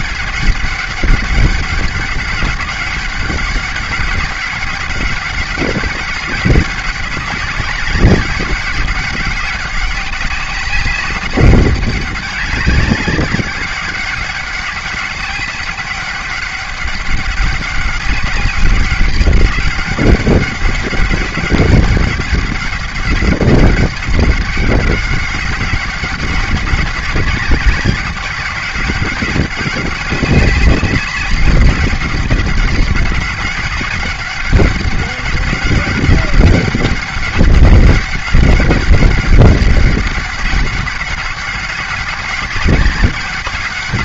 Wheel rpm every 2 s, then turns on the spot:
200, 200, 200, 190, 190, 200, 200, 200, 200, 200, 200, 200, 200, 200, 200, 200, 200, 200, 200, 190, 200, 200.
none